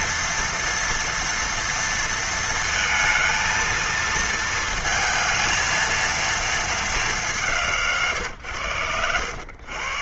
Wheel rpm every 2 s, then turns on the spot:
230, 230, 230, 230, 120.
none